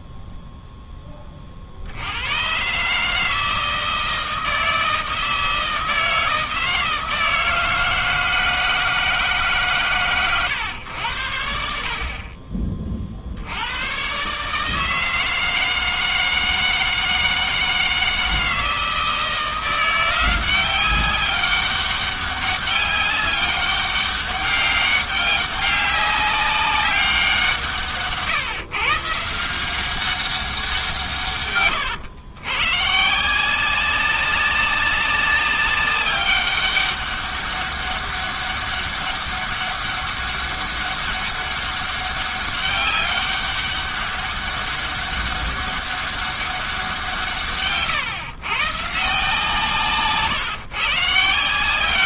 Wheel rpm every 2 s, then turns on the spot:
10, 130, 160, 160, 160, 110, 30, 150, 160, 160, 190, 200, 200, 200, 140, 180, 120, 200, 200, 200, 200, 200, 200, 190, 130, 140.
none